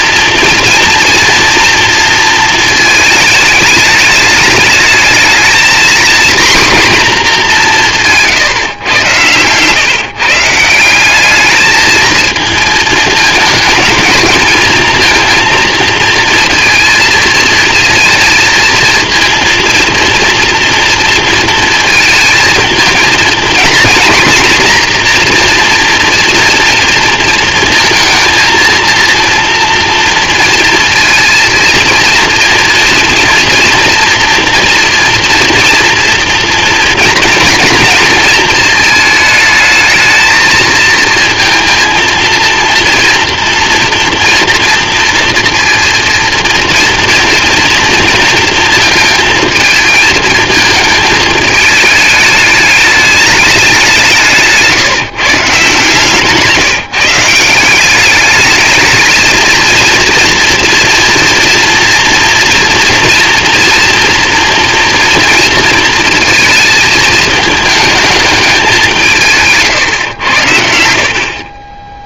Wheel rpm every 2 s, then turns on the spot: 240, 230, 210, 240, 150, 150, 230, 220, 220, 230, 230, 220, 230, 230, 230, 230, 230, 240, 230, 220, 220, 230, 230, 230, 220, 220, 210, 160, 150, 200, 230, 230, 230, 230, 210, 100.
none